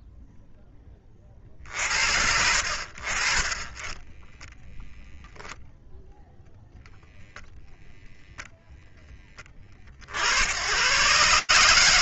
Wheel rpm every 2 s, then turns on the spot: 10, 30, 0, 0, 80, 80.
none